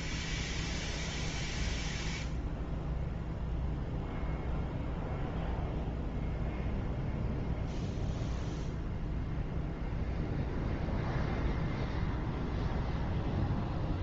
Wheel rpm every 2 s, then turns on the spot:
0, 0, 0, 0, 0, 0, 0.
none